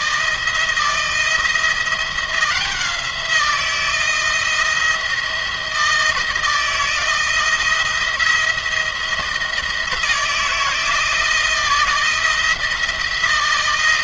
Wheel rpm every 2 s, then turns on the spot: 170, 180, 160, 160, 170, 160, 170.
none